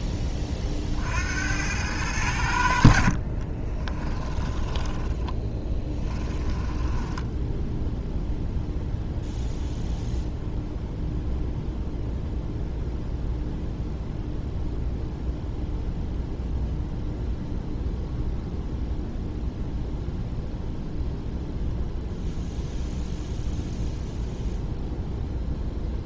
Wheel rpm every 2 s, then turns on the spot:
30, 80, 10, 10, 0, 0, 0, 0, 0, 0, 0, 0, 0.
4-8